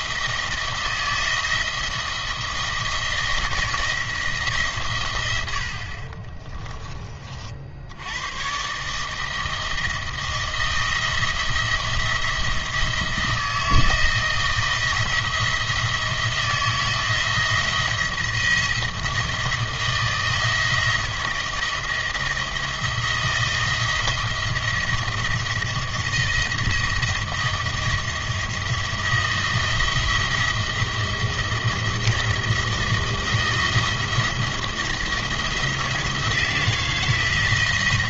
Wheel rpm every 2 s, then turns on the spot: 160, 170, 140, 20, 120, 160, 170, 170, 160, 170, 160, 170, 170, 170, 170, 170, 170, 170, 170.
6-8